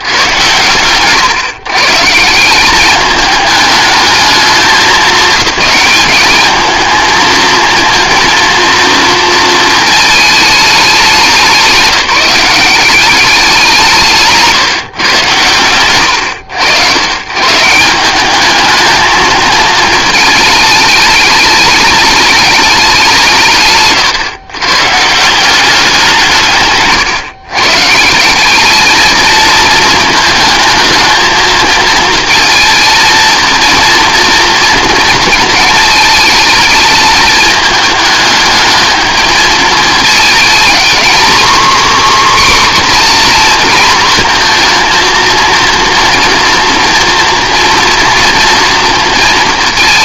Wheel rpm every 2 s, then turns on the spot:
120, 210, 210, 220, 230, 190, 190, 130, 130, 220, 210, 160, 170, 130, 220, 220, 230, 220, 220, 220, 250, 240, 230, 240, 230.
none